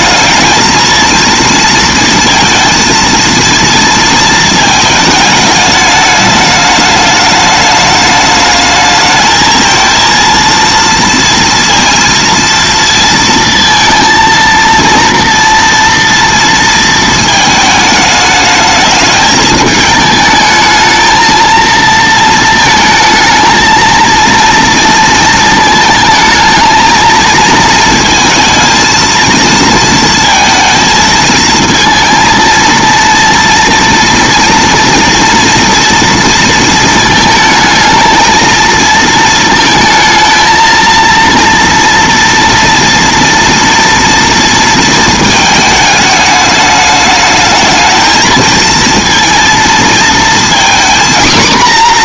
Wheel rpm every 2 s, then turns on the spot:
220, 230, 220, 210, 210, 230, 230, 230, 230, 210, 220, 230, 230, 220, 230, 220, 230, 230, 230, 220, 230, 230, 230, 210, 220, 240.
none